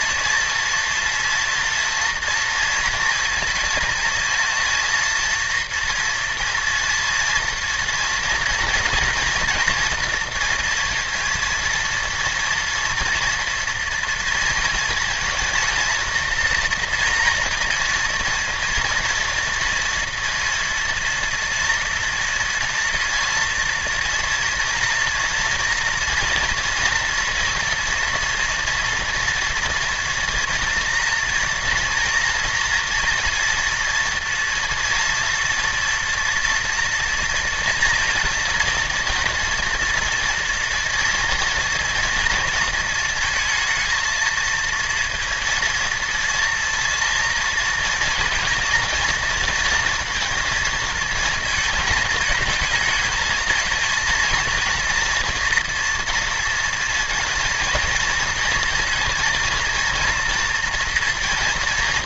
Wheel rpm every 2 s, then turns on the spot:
230, 230, 230, 230, 230, 230, 230, 230, 230, 230, 230, 230, 230, 230, 230, 240, 240, 230, 230, 230, 230, 230, 230, 230, 230, 220, 220, 230, 230, 230, 230.
none